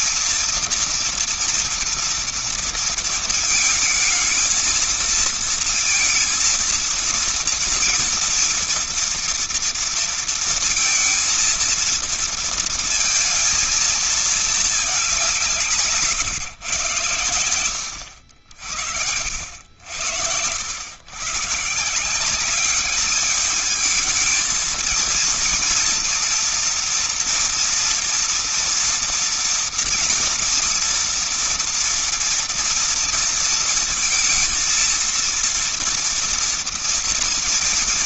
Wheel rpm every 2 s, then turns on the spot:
230, 230, 220, 230, 230, 230, 230, 220, 120, 70, 100, 190, 220, 230, 230, 230, 230, 220, 230.
none